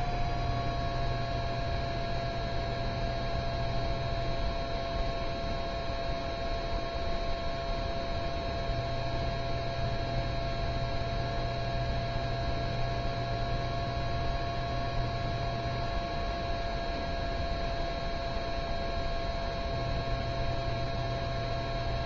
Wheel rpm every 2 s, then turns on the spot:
0, 0, 0, 0, 0, 0, 0, 0, 0, 0, 0.
none